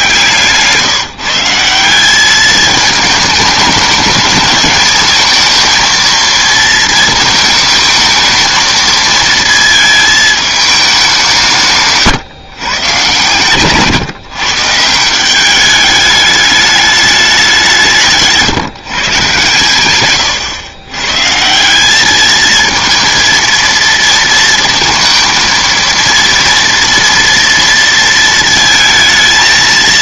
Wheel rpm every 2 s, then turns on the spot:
150, 210, 210, 230, 220, 210, 130, 140, 210, 160, 110, 220, 220, 230, 220.
none